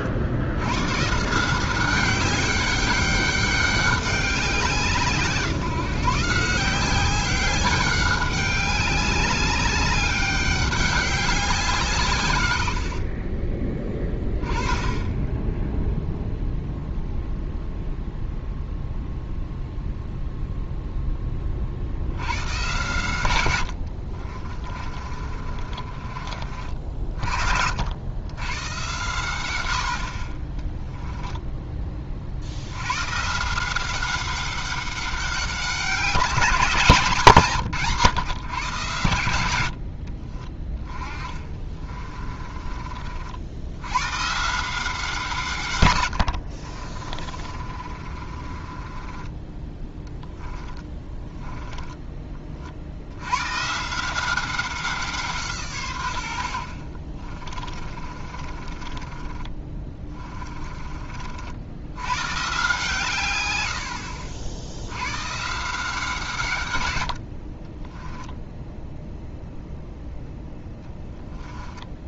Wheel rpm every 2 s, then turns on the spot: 120, 200, 170, 180, 200, 200, 70, 10, 0, 0, 0, 120, 30, 50, 120, 10, 110, 200, 170, 120, 20, 40, 170, 40, 30, 10, 50, 180, 50, 30, 30, 150, 80, 110, 0, 10.
12-14 24-26 30-32 40-42 46-52 56-60 70-72